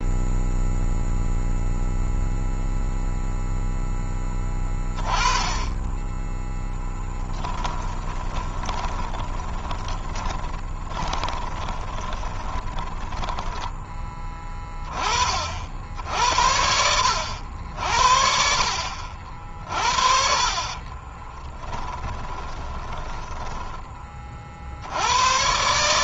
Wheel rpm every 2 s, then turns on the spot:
0, 0, 20, 10, 20, 20, 20, 30, 80, 50, 30, 10, 50.
6-14 20-24